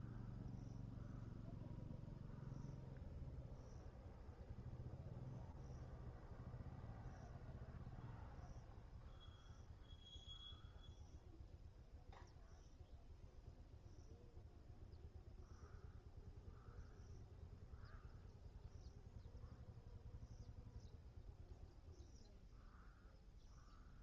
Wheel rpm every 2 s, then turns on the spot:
0, 0, 0, 0, 0, 0, 0, 0, 0, 0, 0, 0.
none